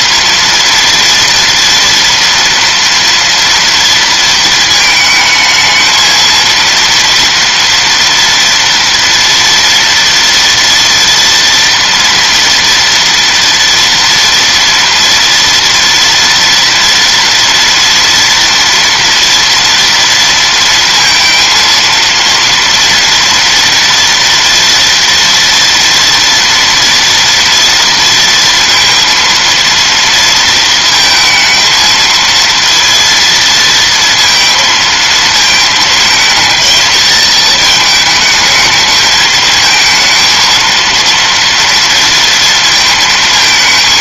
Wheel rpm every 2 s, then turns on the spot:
230, 230, 220, 230, 230, 230, 230, 230, 230, 230, 230, 230, 230, 230, 230, 230, 230, 230, 220, 220, 230, 230.
none